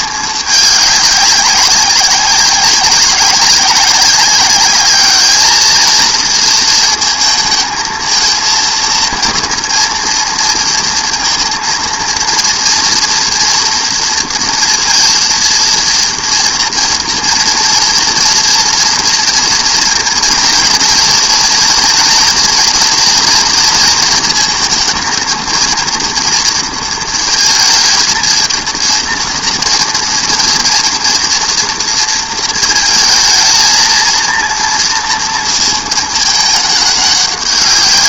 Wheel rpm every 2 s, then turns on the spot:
210, 190, 200, 230, 230, 230, 230, 230, 240, 230, 230, 230, 230, 230, 230, 230, 230, 230, 210.
none